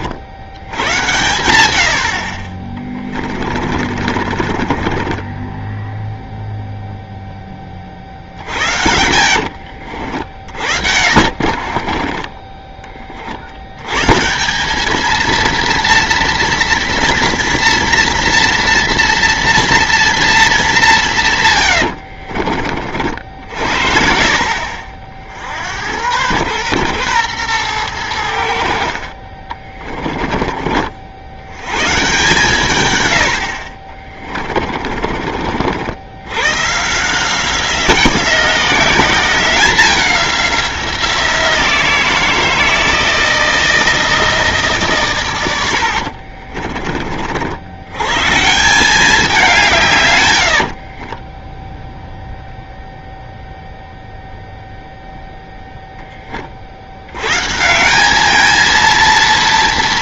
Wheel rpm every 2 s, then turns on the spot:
70, 50, 30, 0, 60, 60, 30, 190, 230, 230, 210, 60, 50, 110, 60, 50, 130, 40, 130, 190, 180, 170, 140, 40, 170, 70, 0, 0, 50, 220.
2-6 8-12 34-36 50-52